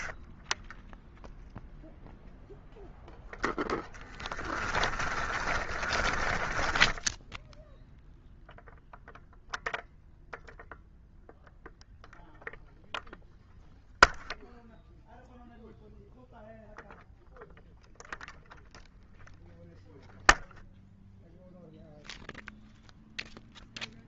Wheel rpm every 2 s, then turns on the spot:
0, 0, 20, 20, 0, 0, 0, 0, 0, 0, 0, 0.
4-8